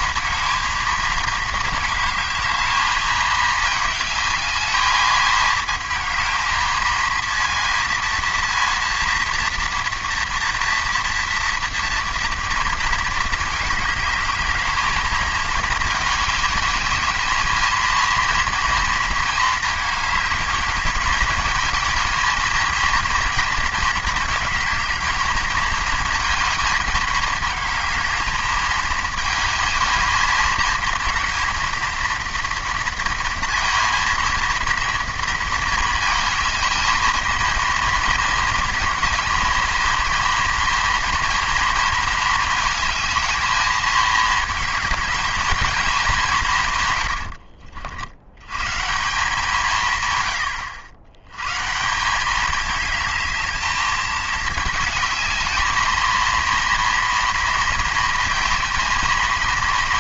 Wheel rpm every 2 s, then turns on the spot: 220, 220, 210, 220, 230, 230, 230, 220, 210, 230, 220, 230, 220, 220, 220, 230, 230, 230, 220, 220, 230, 220, 220, 140, 130, 90, 210, 210, 230, 230.
none